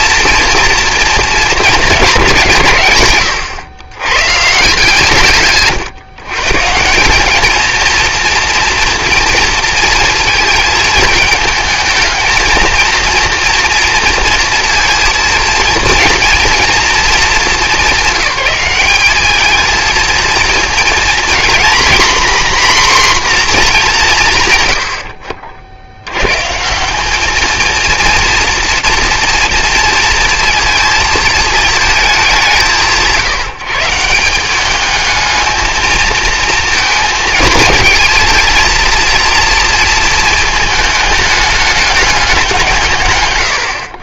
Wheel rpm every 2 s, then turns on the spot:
240, 160, 140, 150, 230, 220, 230, 230, 230, 200, 230, 260, 120, 170, 230, 230, 180, 200, 230, 230, 220, 170.
none